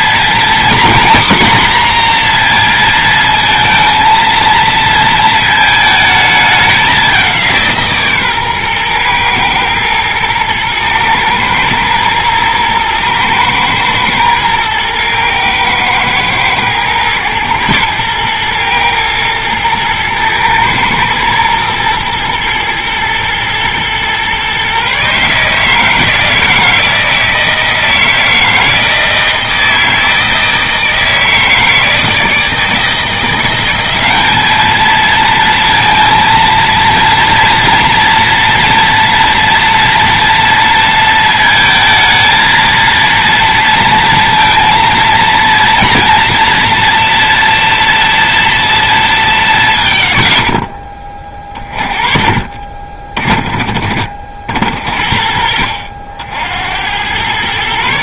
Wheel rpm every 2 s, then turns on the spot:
250, 230, 230, 200, 120, 110, 120, 110, 110, 110, 110, 110, 140, 160, 160, 160, 160, 220, 230, 240, 230, 230, 230, 240, 230, 50, 40, 60, 80.
none